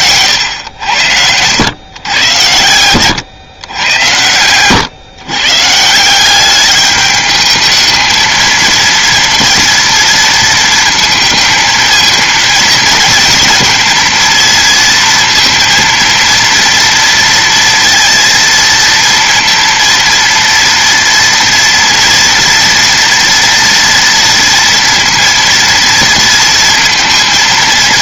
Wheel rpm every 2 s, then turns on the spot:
90, 100, 130, 210, 230, 220, 220, 230, 230, 230, 230, 230, 230, 230.
2-4